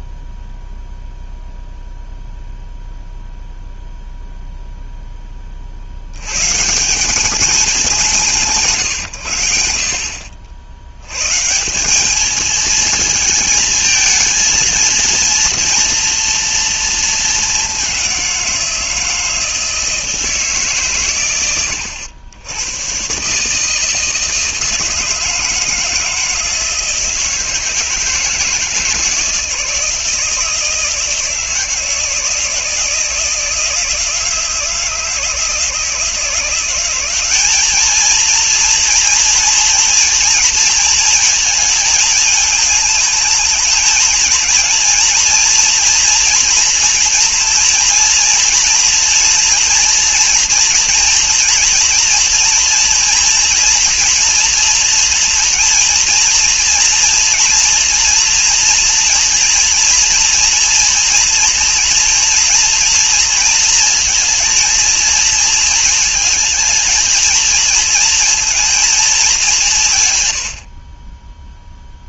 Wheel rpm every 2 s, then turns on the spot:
0, 0, 0, 160, 140, 80, 220, 230, 230, 170, 140, 110, 160, 160, 160, 160, 160, 160, 180, 230, 230, 220, 230, 230, 230, 230, 230, 230, 230, 230, 230, 230, 230, 220, 230, 60.
none